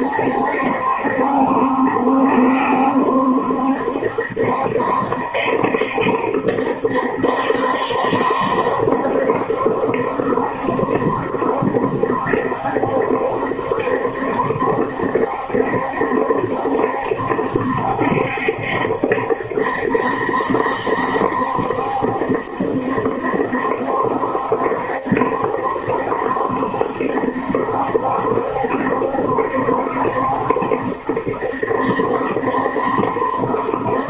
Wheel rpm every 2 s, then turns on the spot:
70, 70, 70, 70, 70, 70, 70, 70, 70, 70, 70, 70, 70, 70, 70, 70, 70.
none